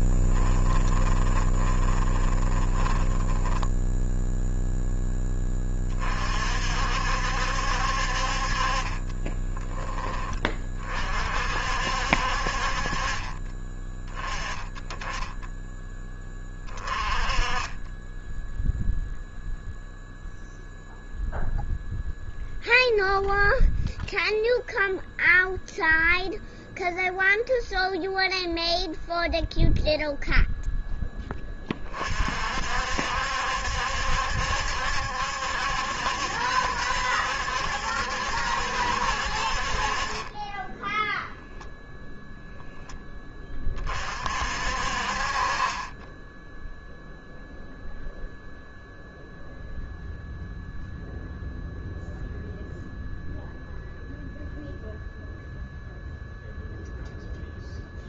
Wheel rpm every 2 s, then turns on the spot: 10, 20, 0, 50, 50, 20, 50, 20, 20, 10, 0, 0, 0, 0, 0, 0, 40, 70, 70, 70, 30, 0, 50, 10, 0, 0, 0, 0, 0.
0-4 40-42